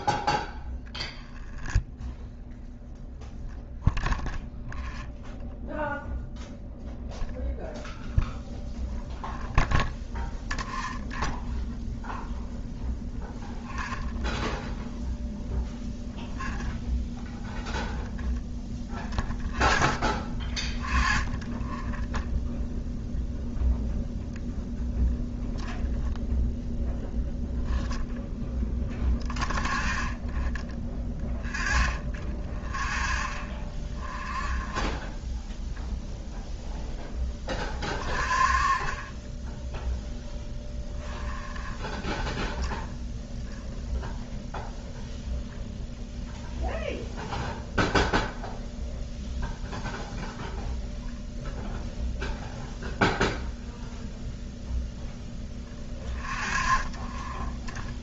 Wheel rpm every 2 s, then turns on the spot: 0, 0, 0, 0, 0, 0, 0, 0, 0, 0, 0, 0, 0, 0, 0, 0, 0, 0, 0, 0, 0, 0, 0, 0, 0, 0, 0, 0, 0.
none